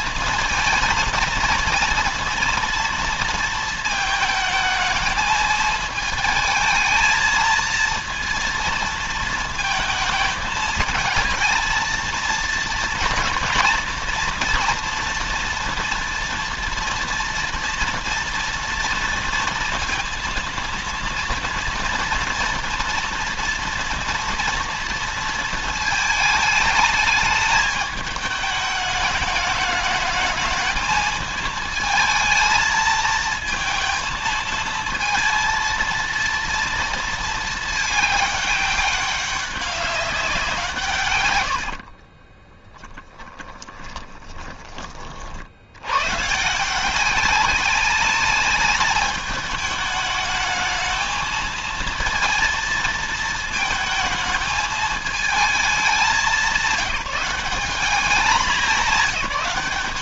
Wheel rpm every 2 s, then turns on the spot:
230, 230, 220, 220, 230, 220, 230, 230, 240, 230, 230, 230, 230, 210, 210, 220, 220, 220, 220, 200, 130, 10, 30, 170, 210, 220, 230, 220, 170, 190.
42-44